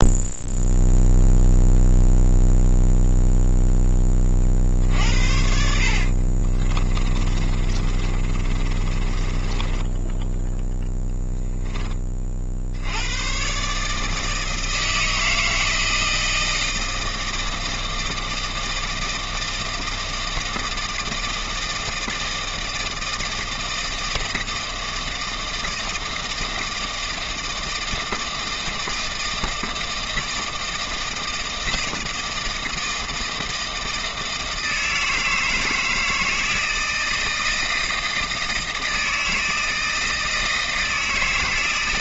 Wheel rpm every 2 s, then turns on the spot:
0, 0, 50, 30, 30, 0, 80, 160, 160, 160, 160, 160, 160, 160, 160, 160, 160, 160, 160, 160, 160.
6-10